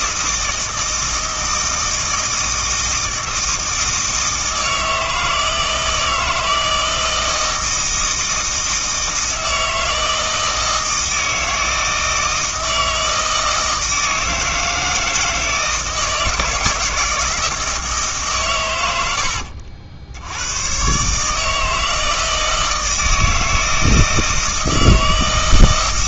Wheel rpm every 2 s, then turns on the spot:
160, 160, 160, 160, 160, 160, 160, 160, 160, 100, 120, 160, 160.
none